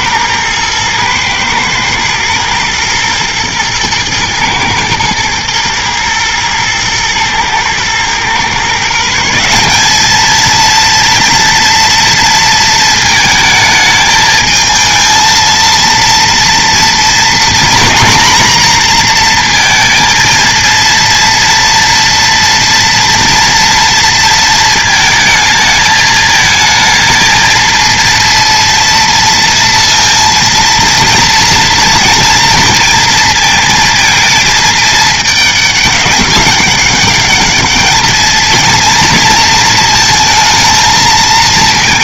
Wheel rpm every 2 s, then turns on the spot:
120, 120, 110, 110, 150, 230, 230, 220, 240, 240, 230, 230, 220, 220, 230, 230, 230, 220, 200, 230, 220.
none